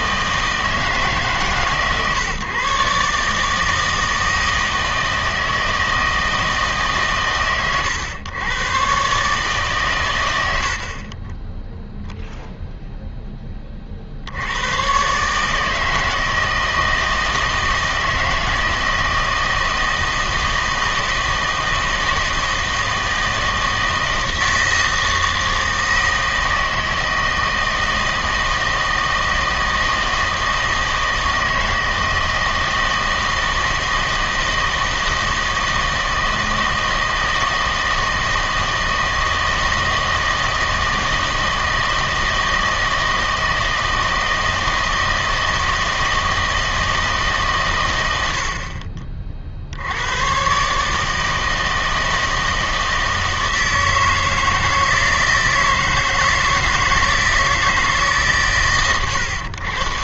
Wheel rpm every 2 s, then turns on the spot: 160, 140, 160, 150, 110, 70, 0, 110, 160, 160, 160, 160, 160, 160, 160, 160, 160, 160, 160, 160, 160, 160, 160, 160, 50, 140, 160, 160, 160, 120.
none